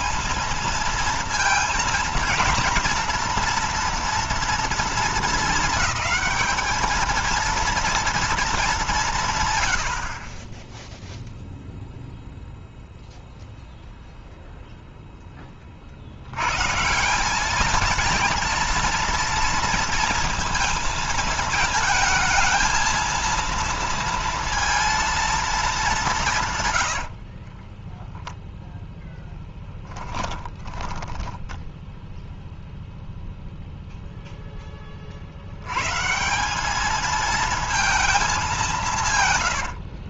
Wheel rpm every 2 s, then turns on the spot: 220, 230, 220, 220, 190, 0, 0, 0, 160, 230, 230, 220, 230, 100, 0, 20, 0, 10, 200, 190.
26-28 30-32